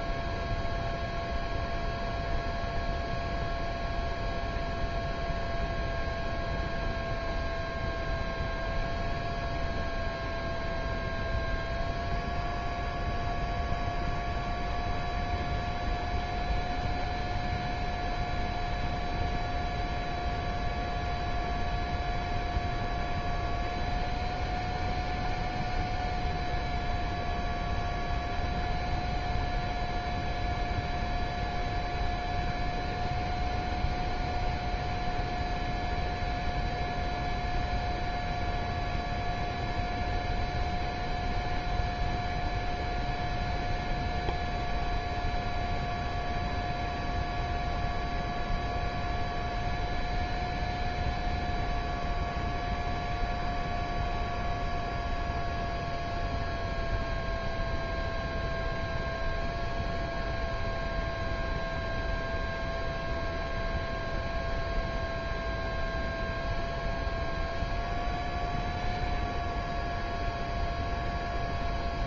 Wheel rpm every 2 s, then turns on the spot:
0, 0, 0, 0, 0, 0, 0, 0, 0, 0, 0, 0, 0, 0, 0, 0, 0, 0, 0, 0, 0, 0, 0, 0, 0, 0, 0, 0, 0, 0, 0, 0, 0, 0, 0, 0.
none